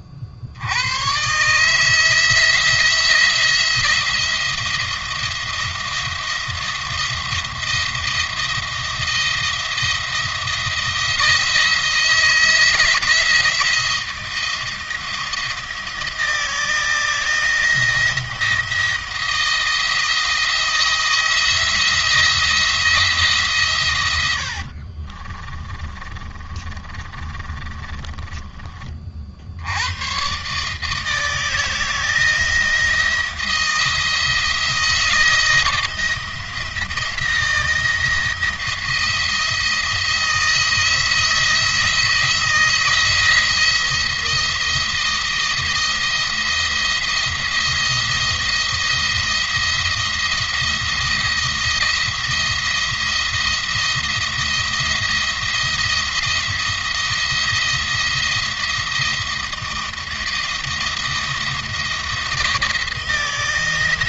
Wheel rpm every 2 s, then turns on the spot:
100, 170, 170, 170, 170, 170, 160, 170, 170, 170, 170, 160, 60, 30, 30, 150, 160, 160, 170, 170, 170, 160, 170, 170, 170, 170, 170, 170, 170, 170, 170, 160.
24-28